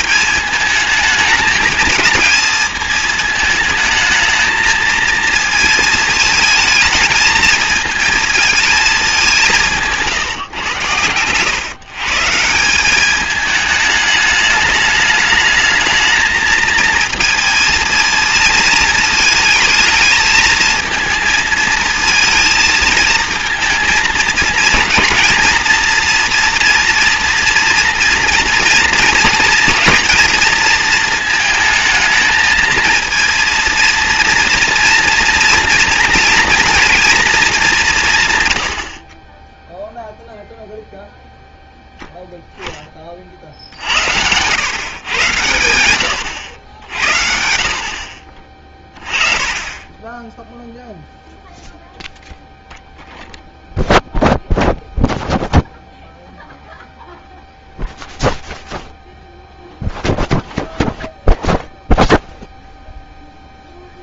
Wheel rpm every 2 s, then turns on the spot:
220, 220, 230, 220, 210, 110, 190, 210, 230, 220, 220, 220, 220, 230, 230, 220, 230, 240, 230, 60, 0, 30, 120, 70, 40, 0, 0, 0, 0, 0, 0, 0.
none